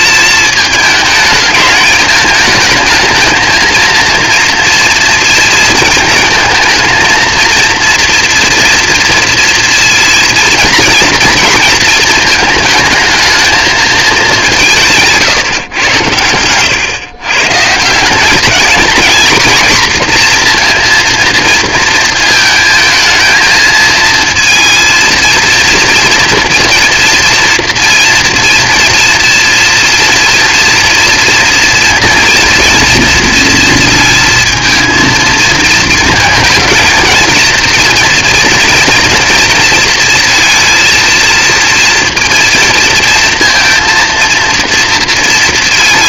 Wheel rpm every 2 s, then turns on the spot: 220, 220, 230, 230, 230, 230, 220, 190, 110, 220, 230, 220, 230, 240, 230, 240, 230, 230, 230, 230, 230, 230, 230.
none